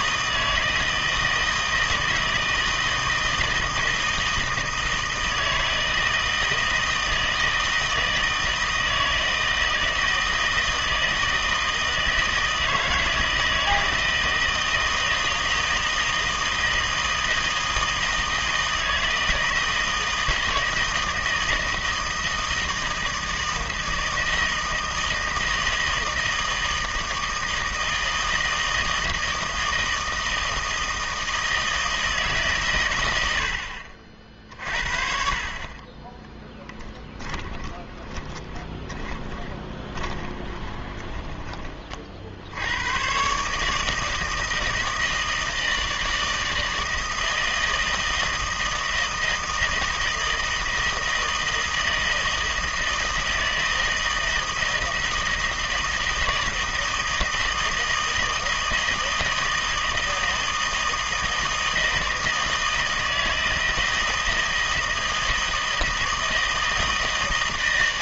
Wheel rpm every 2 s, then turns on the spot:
160, 160, 160, 160, 160, 160, 160, 160, 160, 160, 160, 160, 160, 160, 160, 160, 130, 50, 10, 10, 20, 80, 160, 160, 160, 160, 160, 160, 160, 160, 160, 160, 160, 160.
36-42